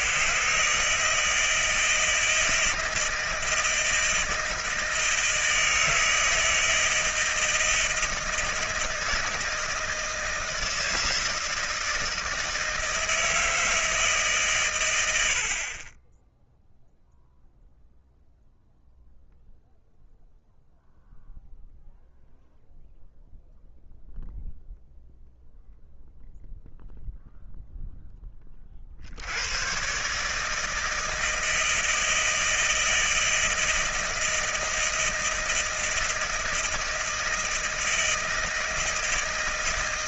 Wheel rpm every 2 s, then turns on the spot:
80, 160, 160, 160, 160, 170, 160, 160, 20, 0, 0, 0, 0, 0, 20, 150, 160, 160, 160, 160.
none